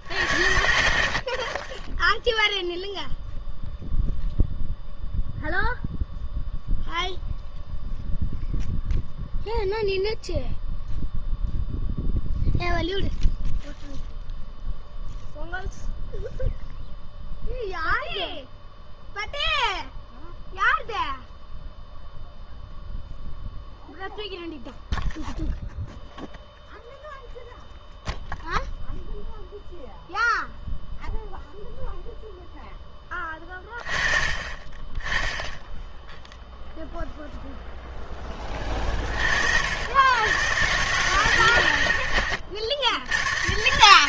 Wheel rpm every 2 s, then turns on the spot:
80, 0, 0, 0, 0, 0, 0, 0, 0, 0, 0, 0, 0, 0, 0, 0, 10, 20, 0, 30, 130, 90.
none